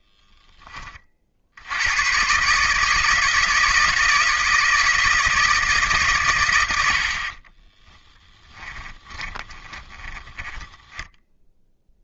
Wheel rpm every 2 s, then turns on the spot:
30, 150, 160, 80, 10, 10.
8-12